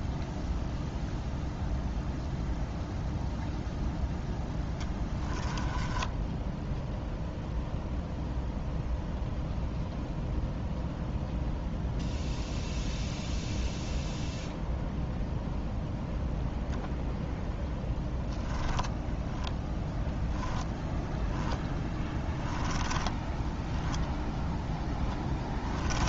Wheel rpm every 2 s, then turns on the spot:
0, 0, 10, 0, 0, 0, 0, 0, 0, 10, 10, 10, 10.
4-6 18-20 22-26